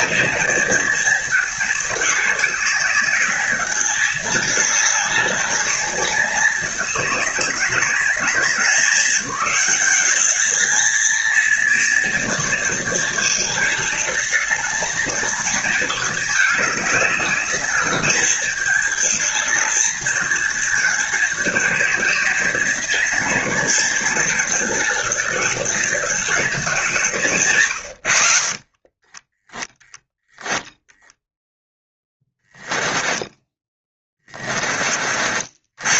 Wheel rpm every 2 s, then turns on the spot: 230, 210, 210, 210, 180, 220, 230, 220, 210, 210, 230, 230, 220, 200, 30, 0, 10, 30.
28-30 32-34